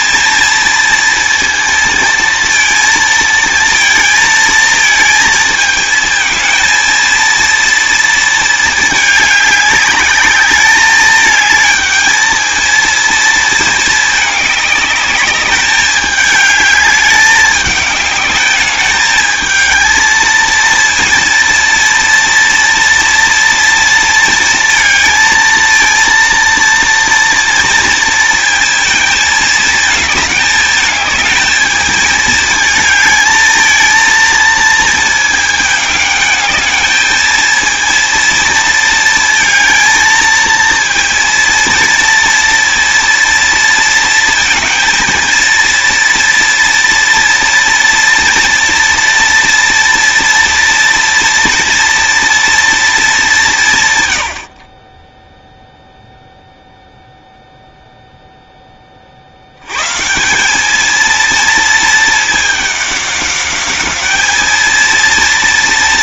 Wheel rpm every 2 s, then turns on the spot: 230, 230, 220, 230, 220, 210, 220, 210, 210, 210, 230, 230, 230, 230, 230, 220, 220, 230, 220, 230, 230, 230, 230, 230, 230, 230, 230, 40, 0, 20, 220, 200, 220.
none